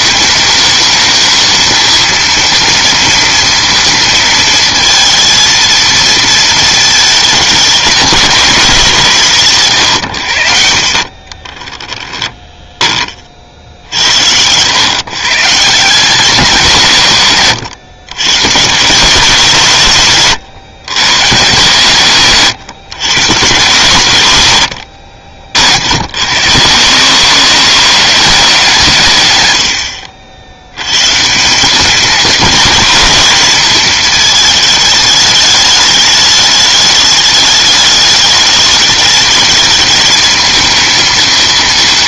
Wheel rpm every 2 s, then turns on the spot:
210, 230, 230, 220, 190, 50, 10, 110, 170, 140, 130, 140, 100, 120, 180, 90, 220, 220, 210, 210, 220.
none